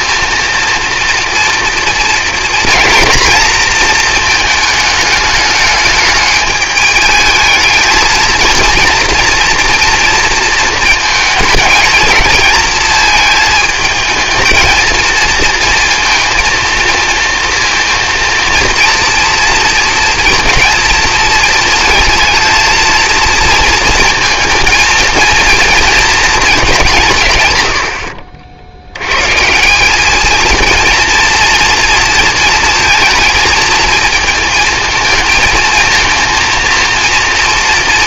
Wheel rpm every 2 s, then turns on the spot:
230, 230, 220, 210, 230, 220, 220, 220, 230, 230, 230, 230, 230, 200, 60, 220, 220, 220, 230.
none